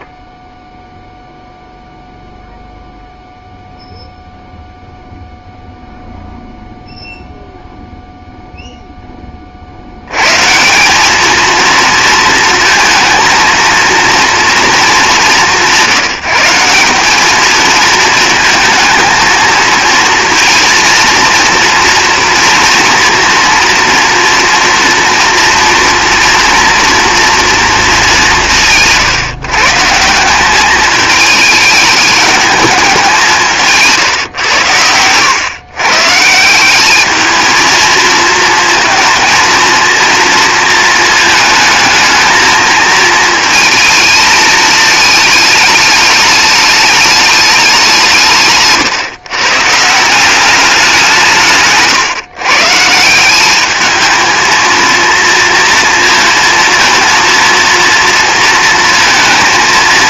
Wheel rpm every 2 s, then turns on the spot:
0, 0, 0, 0, 0, 180, 230, 220, 190, 220, 230, 230, 230, 230, 160, 210, 200, 100, 200, 230, 230, 220, 220, 210, 130, 190, 150, 230, 230, 230.
none